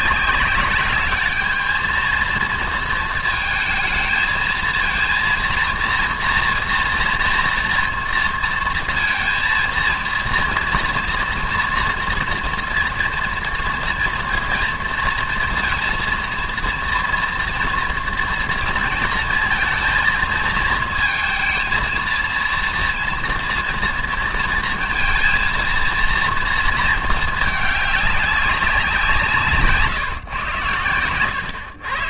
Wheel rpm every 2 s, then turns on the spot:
200, 220, 220, 230, 230, 230, 230, 230, 230, 230, 230, 230, 230, 230, 190, 110.
none